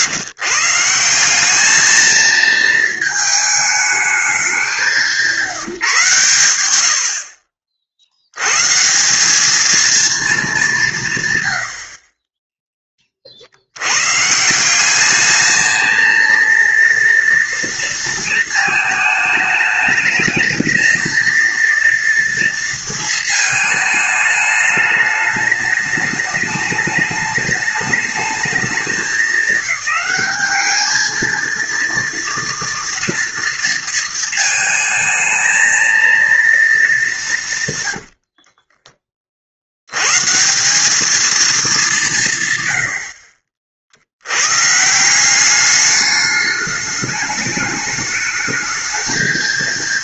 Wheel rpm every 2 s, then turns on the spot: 150, 220, 180, 90, 140, 190, 10, 180, 230, 220, 220, 230, 210, 210, 210, 210, 230, 220, 220, 40, 180, 110, 120, 210, 220.
38-40